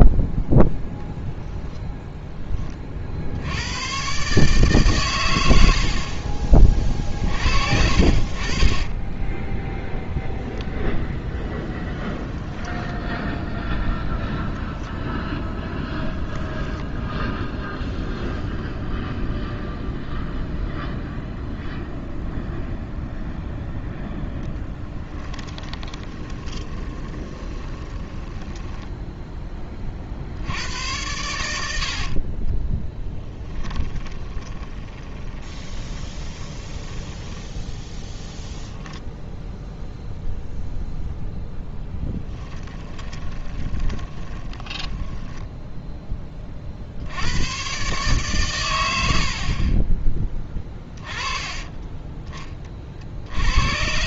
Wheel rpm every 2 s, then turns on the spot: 0, 30, 130, 30, 30, 0, 10, 0, 10, 0, 0, 0, 10, 20, 10, 90, 10, 20, 20, 0, 0, 20, 20, 40, 110, 10, 30.
12-14 16-18 24-30 32-38 42-46